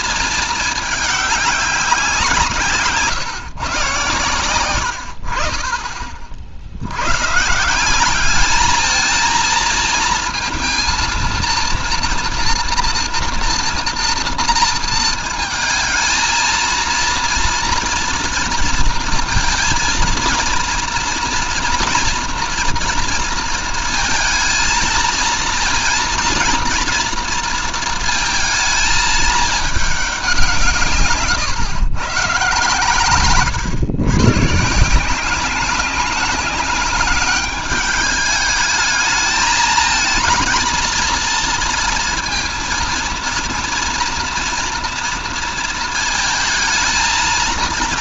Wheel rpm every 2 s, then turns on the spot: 210, 150, 70, 120, 220, 230, 230, 230, 230, 230, 230, 230, 230, 230, 210, 140, 120, 170, 200, 220, 230, 230, 230, 230.
none